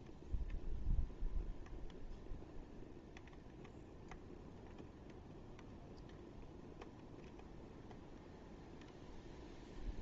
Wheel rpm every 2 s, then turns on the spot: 0, 0, 0, 0, 0.
none